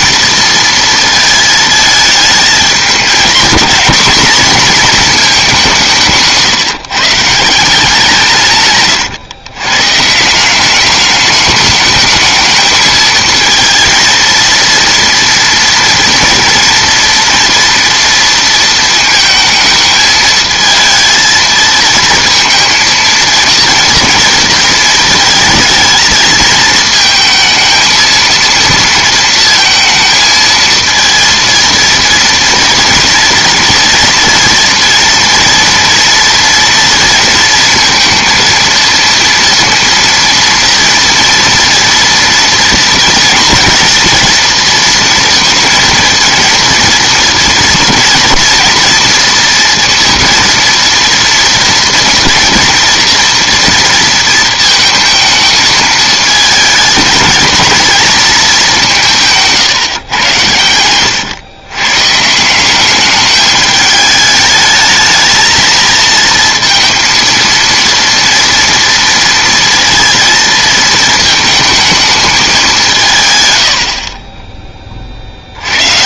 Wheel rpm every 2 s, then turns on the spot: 230, 220, 240, 170, 150, 180, 220, 230, 230, 230, 220, 230, 230, 220, 230, 230, 230, 230, 230, 230, 230, 230, 230, 230, 230, 230, 230, 230, 220, 210, 100, 180, 210, 230, 230, 230, 200, 20.
none